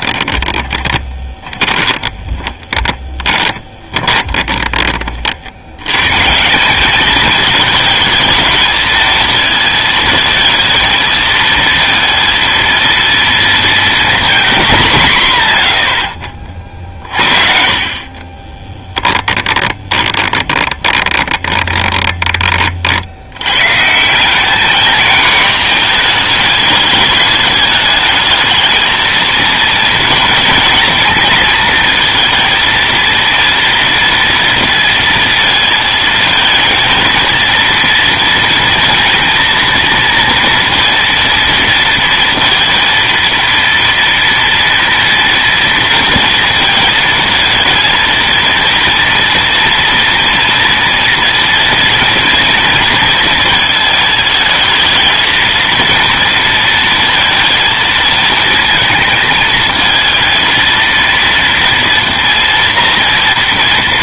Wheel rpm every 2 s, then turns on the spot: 20, 20, 30, 190, 220, 230, 230, 190, 40, 20, 20, 40, 210, 210, 220, 230, 230, 230, 220, 230, 230, 230, 230, 230, 230, 230, 230, 220, 230, 230, 230, 230.
0-4 18-22